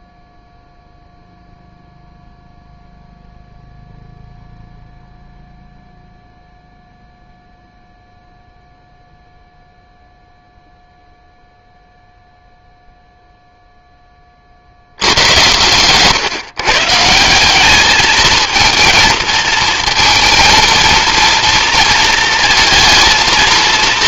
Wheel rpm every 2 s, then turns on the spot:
0, 0, 0, 0, 0, 0, 0, 30, 130, 220, 230, 230.
none